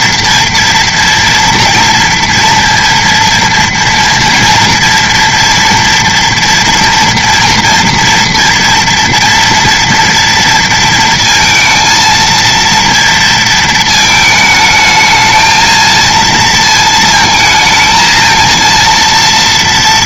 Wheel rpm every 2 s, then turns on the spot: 230, 230, 230, 230, 230, 230, 230, 220, 230, 230.
none